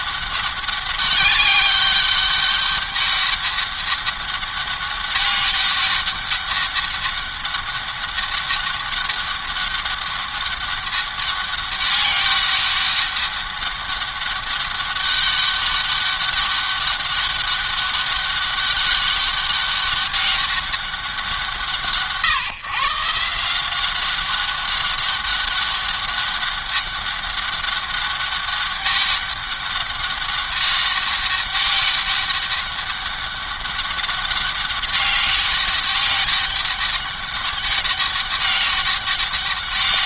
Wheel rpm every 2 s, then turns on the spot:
200, 200, 200, 200, 200, 200, 200, 200, 200, 200, 190, 150, 190, 200, 200, 200, 200, 200, 200, 200.
none